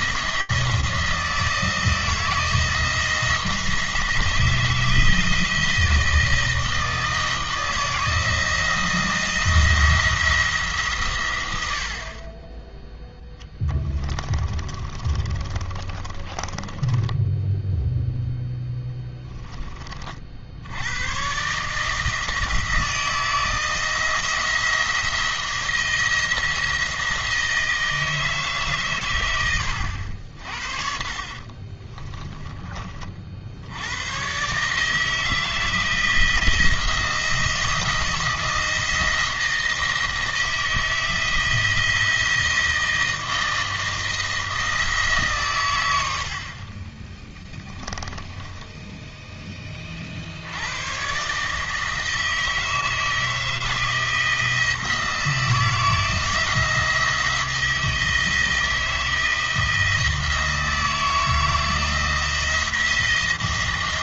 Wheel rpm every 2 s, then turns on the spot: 170, 170, 160, 160, 170, 140, 10, 20, 10, 10, 100, 160, 170, 160, 130, 50, 30, 150, 170, 170, 160, 160, 150, 20, 10, 110, 160, 170, 170, 170, 160, 170.
14-18